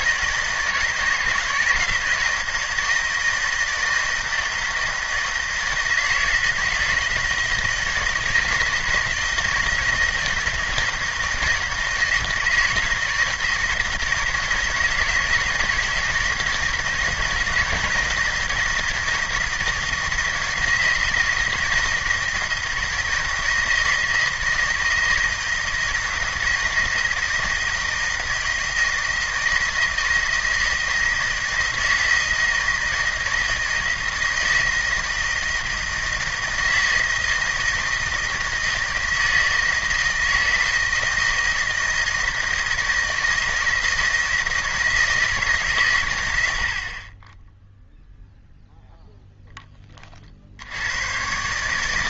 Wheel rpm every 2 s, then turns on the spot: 160, 160, 160, 160, 160, 170, 160, 160, 160, 160, 170, 160, 160, 160, 160, 160, 160, 160, 160, 160, 160, 160, 160, 80, 0, 80.
none